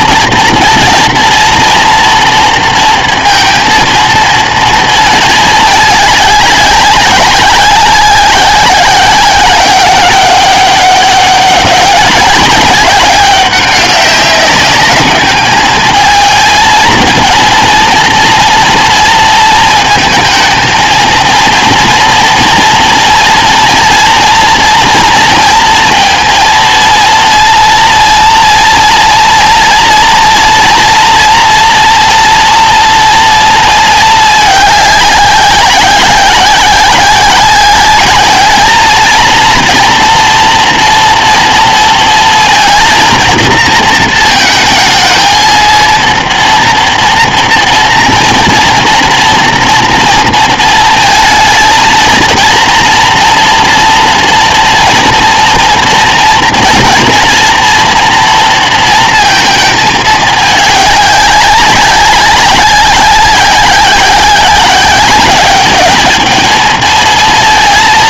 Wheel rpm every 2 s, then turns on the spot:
230, 230, 230, 200, 190, 200, 200, 200, 220, 230, 230, 240, 230, 230, 240, 230, 230, 210, 190, 210, 230, 230, 220, 230, 230, 230, 230, 230, 230, 230, 210, 190, 190, 220.
none